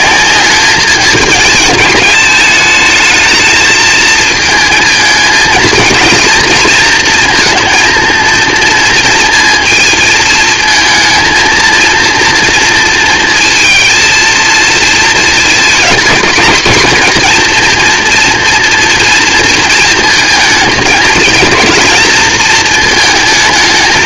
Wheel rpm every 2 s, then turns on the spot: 200, 210, 230, 230, 230, 220, 230, 230, 230, 230, 220, 220.
none